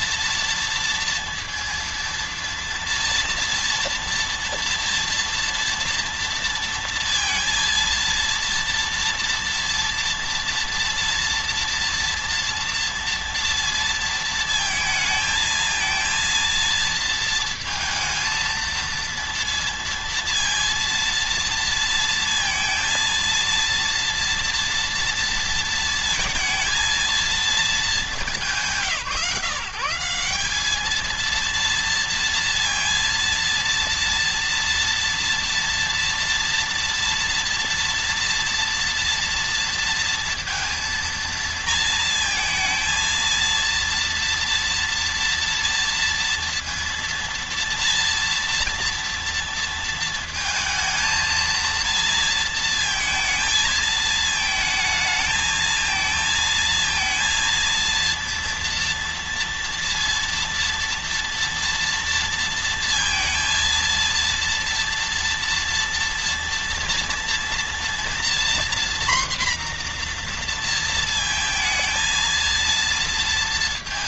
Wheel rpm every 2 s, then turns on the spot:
230, 230, 230, 230, 230, 230, 230, 230, 230, 230, 230, 230, 230, 220, 160, 210, 230, 230, 230, 230, 230, 230, 230, 230, 230, 230, 220, 220, 230, 240, 230, 230, 230, 230, 250, 230, 230.
none